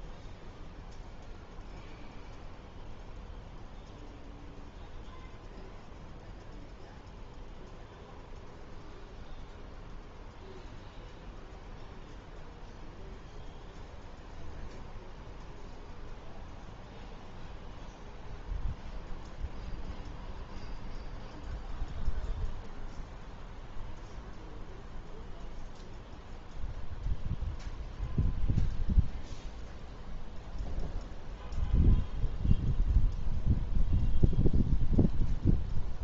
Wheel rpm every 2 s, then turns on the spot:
0, 0, 0, 0, 0, 0, 0, 0, 0, 0, 0, 0, 0, 0, 0, 0, 0, 0.
none